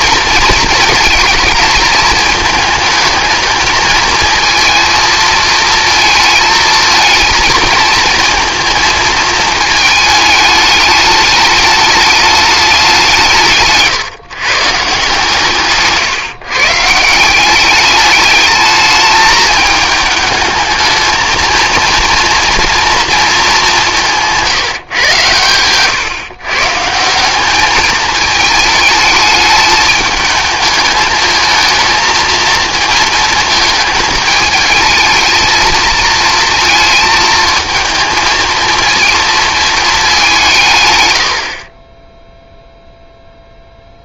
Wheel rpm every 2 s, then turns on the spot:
230, 220, 230, 220, 230, 220, 210, 150, 140, 210, 220, 230, 160, 140, 220, 210, 230, 220, 230, 230, 160, 0.
none